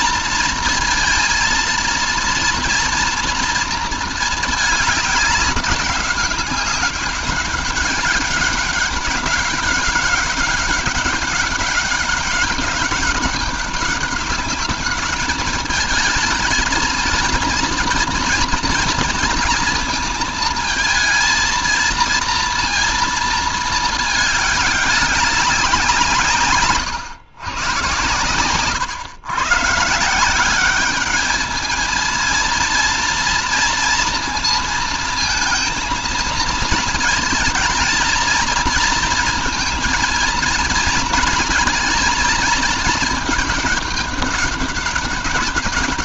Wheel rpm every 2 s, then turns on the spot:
230, 230, 210, 190, 190, 200, 200, 200, 220, 230, 220, 230, 210, 150, 120, 190, 230, 230, 220, 220, 230, 220, 200.
none